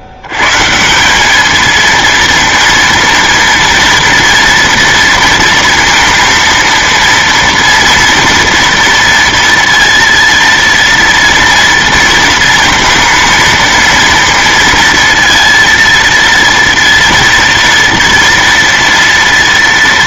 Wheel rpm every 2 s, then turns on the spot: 70, 230, 230, 230, 230, 230, 230, 230, 230, 230.
none